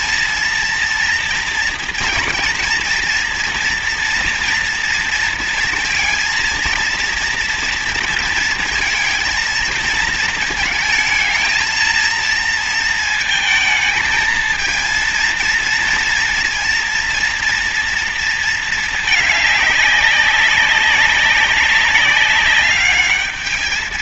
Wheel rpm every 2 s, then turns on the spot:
230, 230, 230, 230, 230, 220, 230, 220, 230, 220, 200, 210.
none